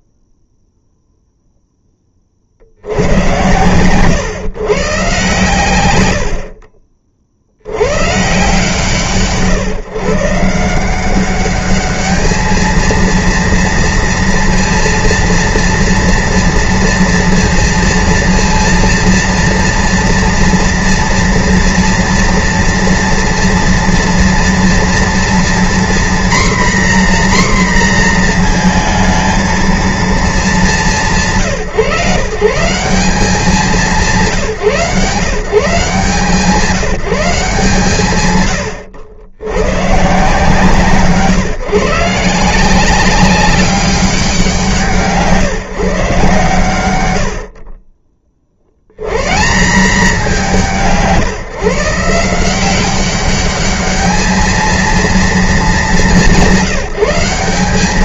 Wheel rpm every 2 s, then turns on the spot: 0, 60, 120, 40, 140, 160, 220, 230, 230, 230, 230, 230, 230, 250, 230, 190, 150, 170, 160, 110, 150, 180, 170, 120, 70, 170, 180, 220, 190.
none